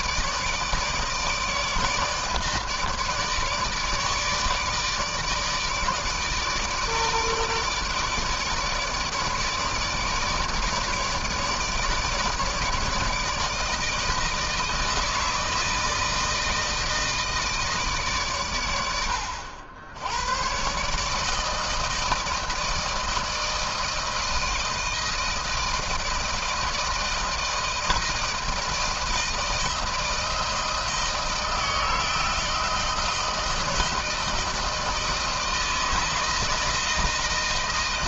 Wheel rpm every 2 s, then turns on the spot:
150, 150, 150, 150, 160, 160, 150, 160, 160, 110, 120, 160, 160, 160, 160, 160, 160, 160, 160.
none